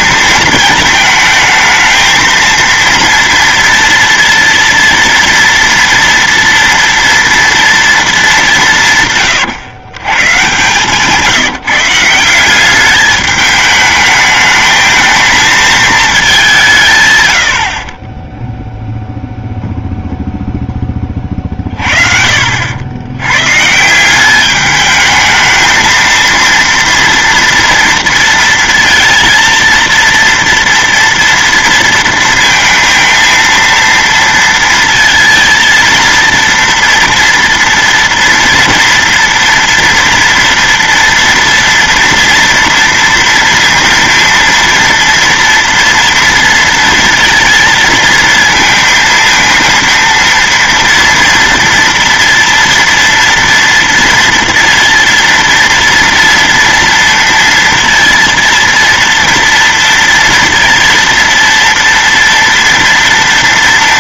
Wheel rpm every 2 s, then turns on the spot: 220, 230, 230, 230, 180, 140, 190, 220, 170, 0, 10, 90, 210, 230, 230, 230, 230, 230, 230, 230, 240, 230, 230, 230, 230, 230, 230, 230, 230, 230, 230, 230.
10-12